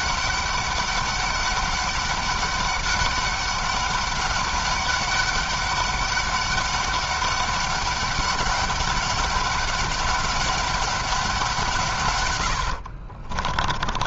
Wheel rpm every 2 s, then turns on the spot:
200, 200, 200, 200, 200, 200, 70.
12-14